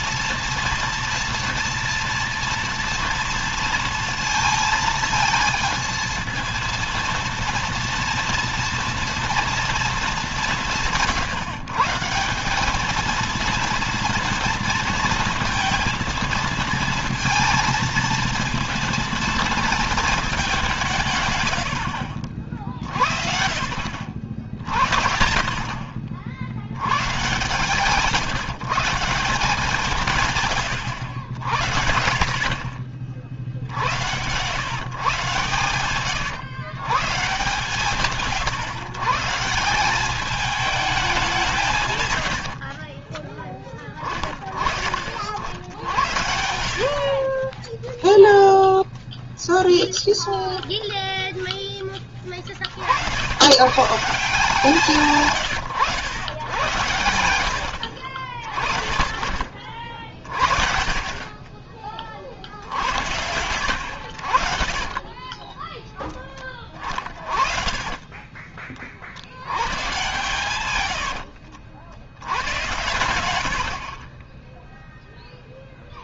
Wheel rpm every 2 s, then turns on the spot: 230, 230, 220, 230, 230, 170, 210, 230, 230, 230, 190, 50, 40, 100, 170, 110, 40, 130, 130, 140, 210, 50, 40, 60, 0, 0, 60, 160, 110, 50, 50, 60, 40, 30, 40, 90, 90, 0.
42-44 46-48 64-66 70-72